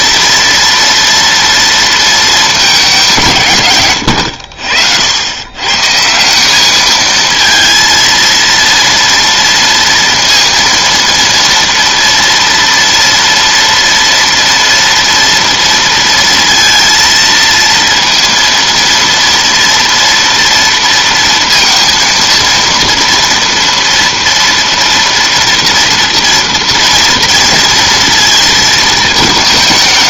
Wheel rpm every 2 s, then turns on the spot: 240, 210, 70, 200, 230, 230, 230, 230, 230, 230, 230, 230, 230, 230, 220.
none